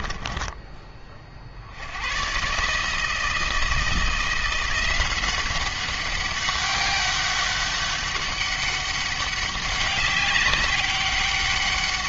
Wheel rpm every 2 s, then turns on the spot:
20, 160, 180, 200, 200, 190.
none